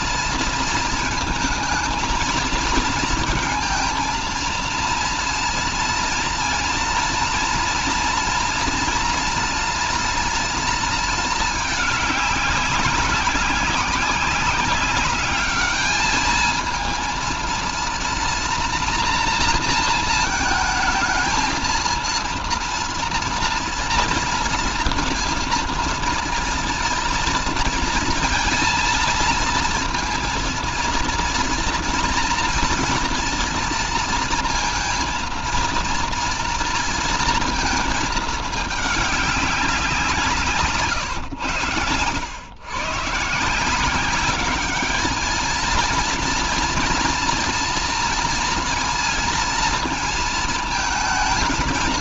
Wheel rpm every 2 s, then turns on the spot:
220, 230, 230, 240, 230, 230, 190, 200, 220, 240, 220, 230, 230, 230, 230, 230, 240, 230, 230, 210, 140, 130, 210, 230, 230, 220.
none